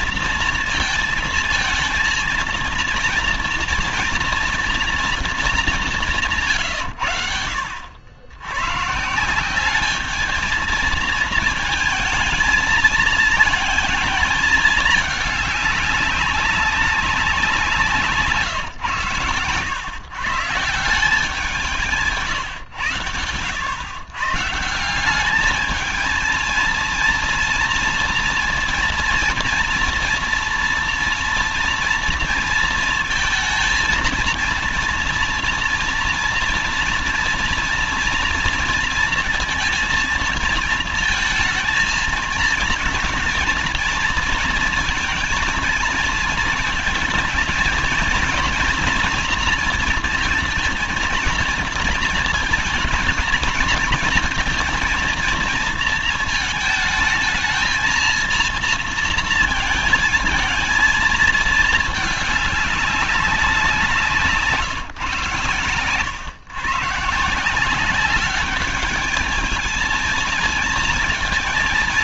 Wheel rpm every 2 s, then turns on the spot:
230, 230, 230, 150, 120, 220, 220, 210, 200, 130, 150, 130, 150, 230, 230, 230, 230, 230, 230, 230, 230, 230, 230, 220, 240, 230, 230, 230, 220, 230, 230, 200, 160, 130, 210, 230.
none